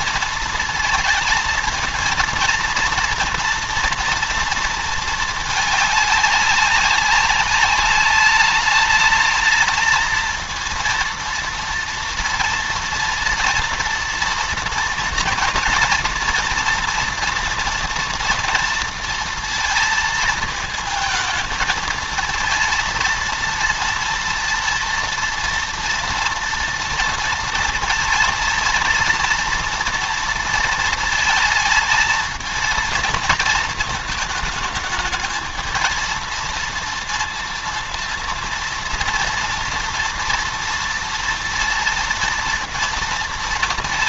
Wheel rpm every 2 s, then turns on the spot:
220, 220, 230, 200, 210, 230, 240, 240, 230, 230, 220, 230, 230, 230, 230, 230, 220, 220, 230, 230, 230, 230.
none